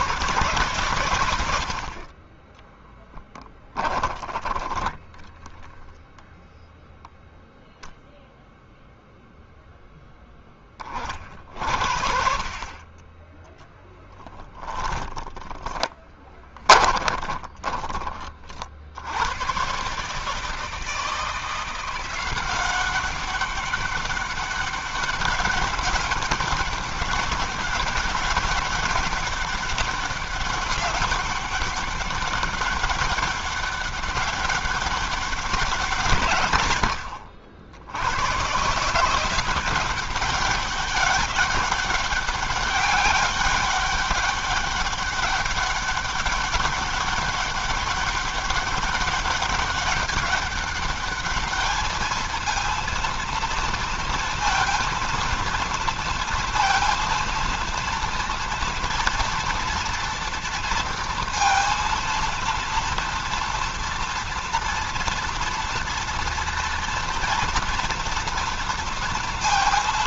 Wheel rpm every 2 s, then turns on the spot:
120, 10, 10, 0, 0, 30, 20, 10, 20, 70, 160, 190, 200, 200, 200, 200, 200, 200, 110, 150, 200, 200, 200, 200, 200, 200, 230, 230, 230, 230, 230, 230, 230, 230, 230.
4-6 14-18